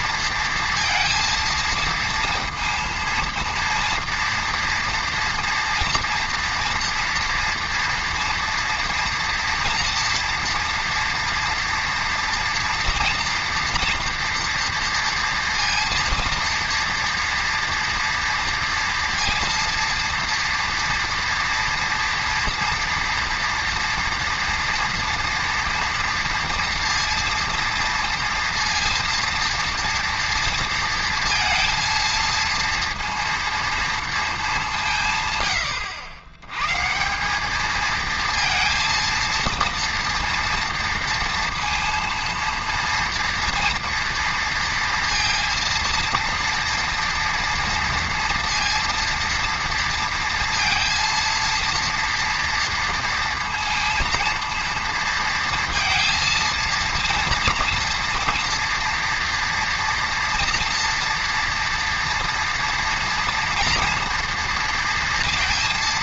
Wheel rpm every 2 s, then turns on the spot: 230, 230, 230, 230, 230, 230, 230, 230, 230, 230, 230, 230, 230, 230, 230, 230, 230, 190, 120, 230, 230, 230, 230, 230, 230, 230, 230, 230, 230, 230, 230, 230, 230.
none